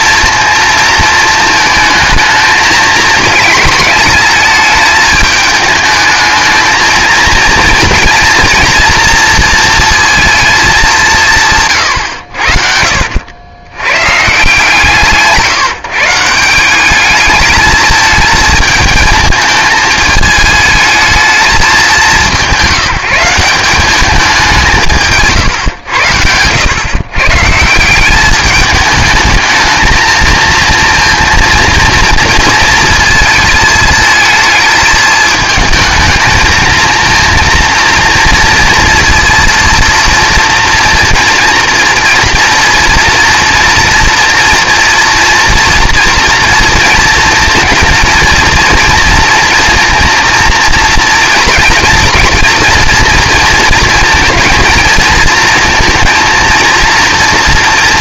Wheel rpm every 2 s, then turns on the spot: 230, 220, 220, 220, 230, 210, 70, 160, 180, 220, 220, 190, 180, 110, 210, 230, 220, 220, 220, 230, 230, 230, 240, 230, 230, 230, 230, 230, 230.
12-14